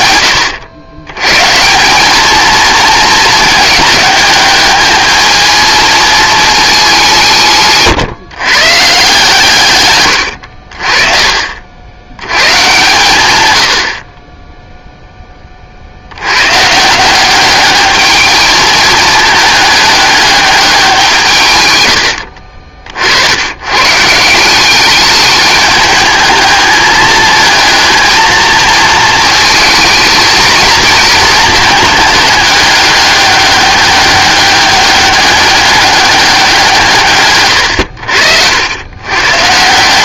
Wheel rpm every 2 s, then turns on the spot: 90, 220, 210, 210, 140, 60, 120, 0, 140, 220, 190, 50, 190, 210, 220, 220, 210, 200, 170, 90.
none